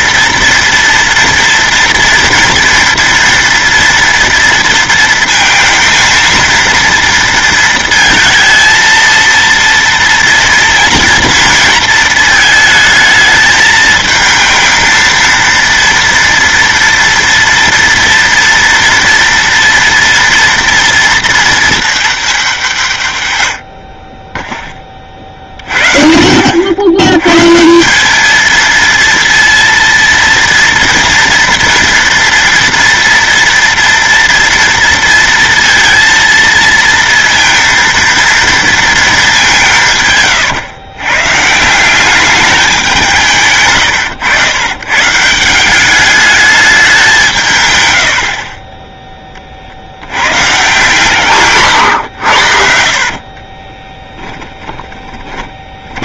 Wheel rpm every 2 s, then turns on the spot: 230, 230, 230, 230, 220, 230, 220, 220, 230, 230, 230, 200, 20, 70, 220, 230, 230, 230, 230, 230, 110, 200, 100, 210, 30, 130, 70, 10.
52-54